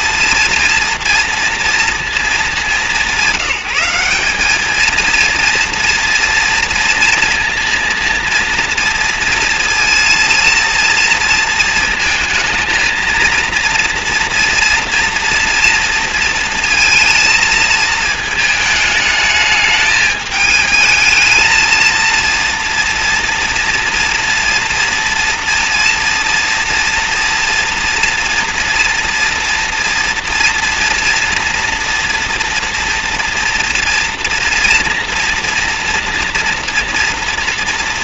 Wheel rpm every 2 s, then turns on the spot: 230, 200, 220, 230, 230, 230, 230, 240, 230, 220, 220, 230, 230, 230, 230, 230, 240, 230, 230.
none